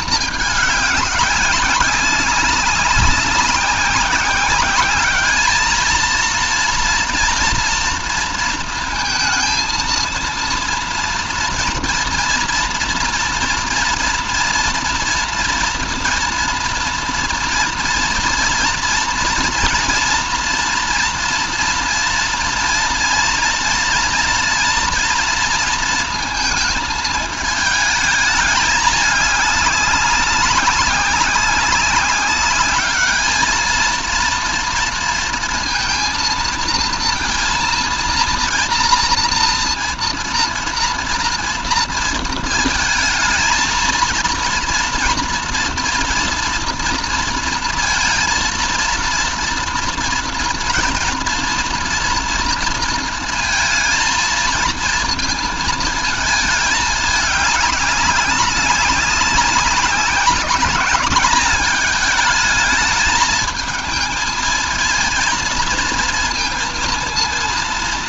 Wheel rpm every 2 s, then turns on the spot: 200, 190, 200, 230, 230, 230, 230, 230, 230, 230, 240, 230, 230, 220, 210, 190, 210, 230, 230, 230, 230, 220, 230, 230, 230, 230, 230, 230, 210, 190, 200, 220, 220, 230.
none